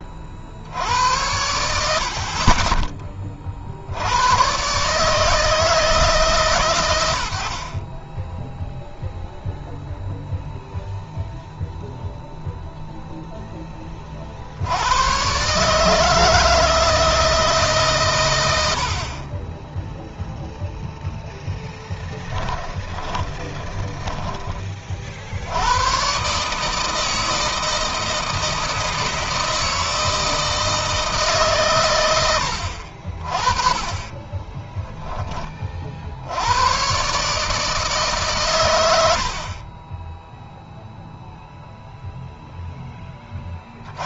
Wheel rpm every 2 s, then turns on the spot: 90, 30, 140, 100, 0, 0, 0, 100, 160, 60, 0, 20, 40, 160, 160, 160, 50, 10, 120, 100, 0, 10.
22-24